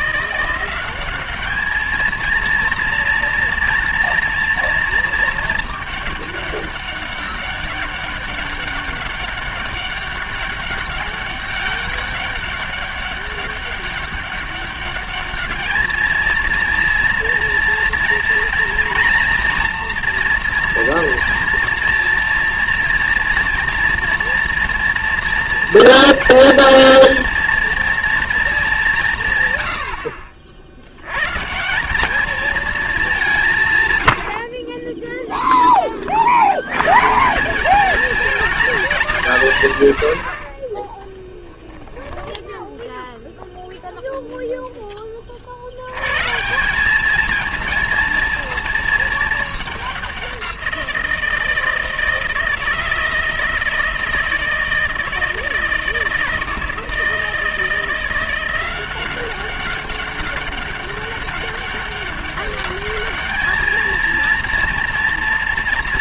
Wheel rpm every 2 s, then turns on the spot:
180, 230, 230, 200, 200, 200, 200, 200, 230, 230, 230, 230, 230, 230, 220, 60, 220, 50, 90, 220, 50, 0, 0, 170, 230, 180, 160, 160, 160, 180, 200, 200, 230.
34-36